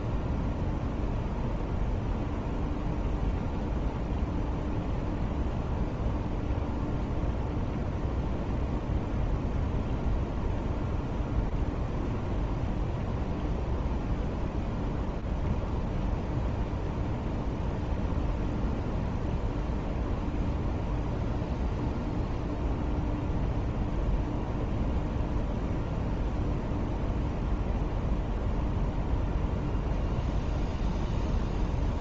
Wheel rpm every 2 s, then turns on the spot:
0, 0, 0, 0, 0, 0, 0, 0, 0, 0, 0, 0, 0, 0, 0, 0.
none